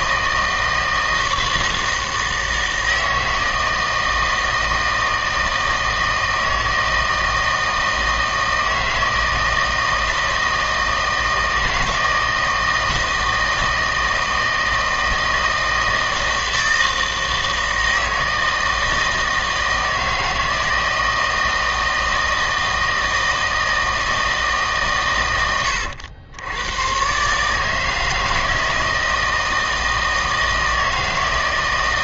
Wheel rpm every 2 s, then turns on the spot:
160, 160, 160, 160, 160, 160, 160, 160, 160, 160, 160, 160, 150, 110, 160, 160.
none